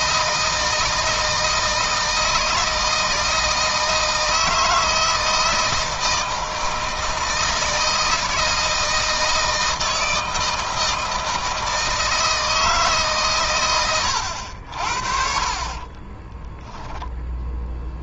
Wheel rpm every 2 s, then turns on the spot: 160, 160, 160, 160, 160, 160, 150, 70, 10.
16-18